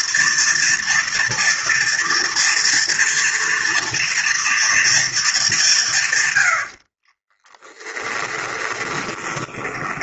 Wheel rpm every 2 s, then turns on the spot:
230, 230, 230, 90, 30.
8-10